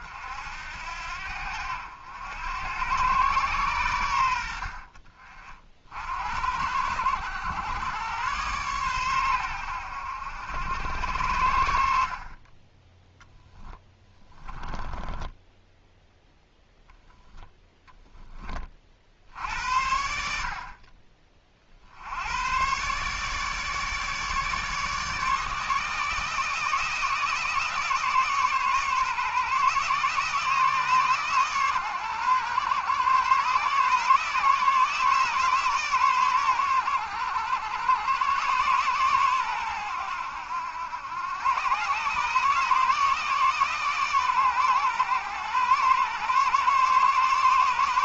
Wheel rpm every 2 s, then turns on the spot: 80, 100, 70, 80, 120, 90, 20, 10, 0, 30, 50, 120, 150, 160, 140, 150, 120, 150, 100, 130, 90, 150, 130, 140.
14-16